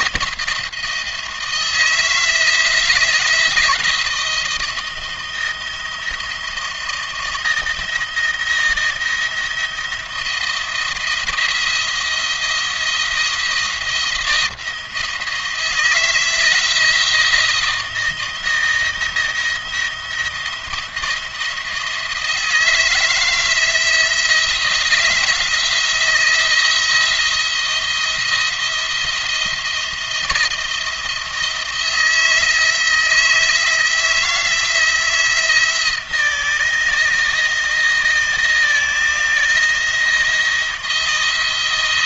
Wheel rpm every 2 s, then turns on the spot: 170, 160, 160, 170, 160, 170, 170, 170, 170, 170, 170, 160, 170, 170, 170, 170, 160, 170, 170, 160, 170.
none